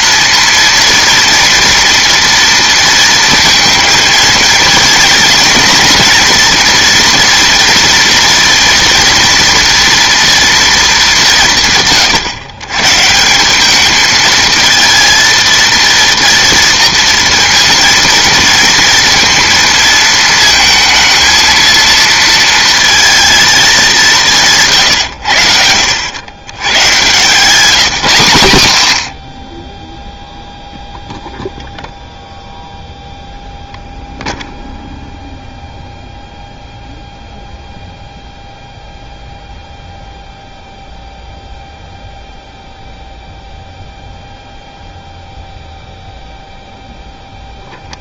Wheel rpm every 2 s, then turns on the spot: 230, 230, 230, 230, 230, 230, 130, 220, 230, 230, 220, 230, 160, 110, 120, 0, 0, 0, 0, 0, 0, 0, 0, 0.
none